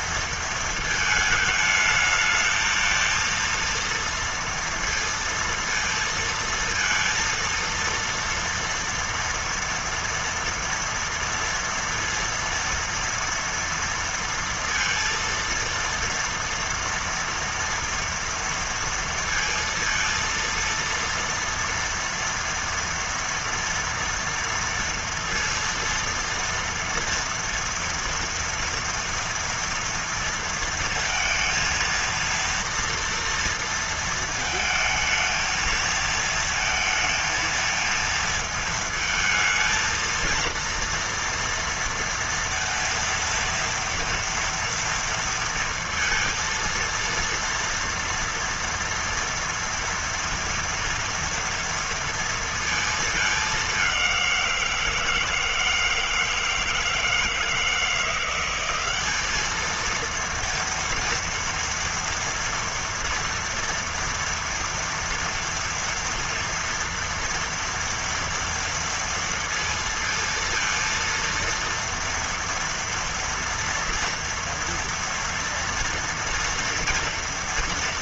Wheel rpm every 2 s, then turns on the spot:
230, 220, 230, 230, 230, 240, 230, 230, 230, 230, 230, 230, 230, 230, 230, 230, 230, 220, 220, 230, 230, 230, 230, 230, 230, 230, 230, 190, 160, 180, 230, 230, 230, 230, 230, 230, 230, 230, 230.
none